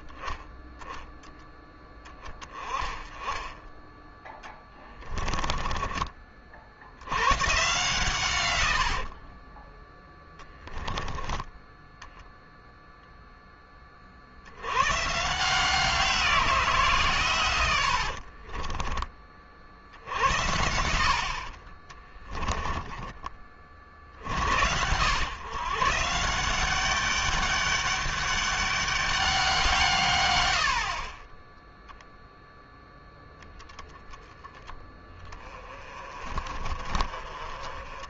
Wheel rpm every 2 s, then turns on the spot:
20, 20, 10, 80, 70, 10, 0, 100, 160, 30, 70, 20, 80, 190, 200, 50, 10, 20, 30.
4-6 8-10 20-24